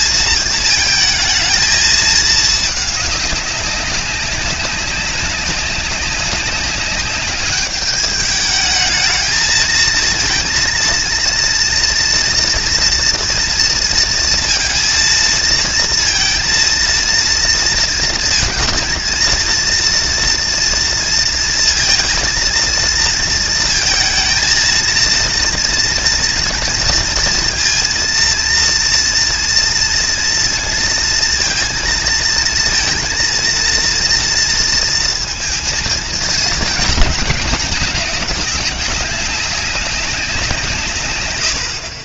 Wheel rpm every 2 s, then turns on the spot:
220, 210, 190, 190, 210, 230, 230, 230, 230, 220, 230, 230, 230, 230, 230, 230, 230, 230, 220, 190, 170.
none